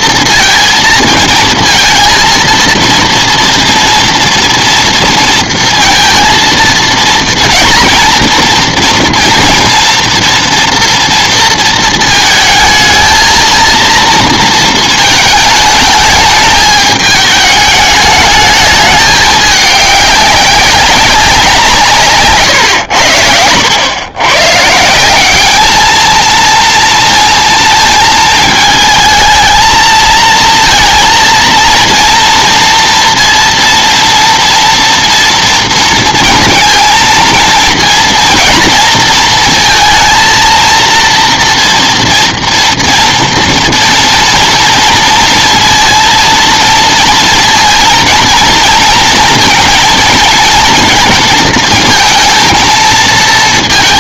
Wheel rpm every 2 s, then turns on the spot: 230, 230, 230, 230, 240, 240, 220, 220, 210, 210, 200, 120, 150, 230, 220, 230, 230, 230, 230, 230, 230, 230, 230, 230, 220, 220, 220.
22-24